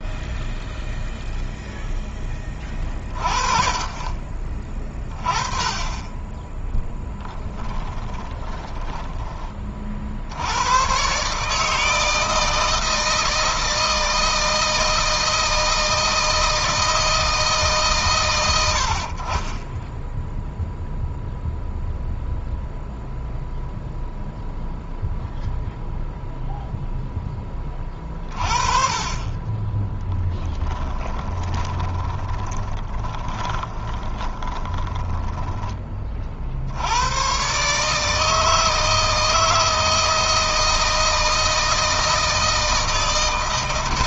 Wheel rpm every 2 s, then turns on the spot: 0, 20, 30, 20, 20, 110, 160, 160, 160, 100, 0, 0, 0, 0, 40, 10, 20, 20, 80, 160, 160, 160.
6-10 30-36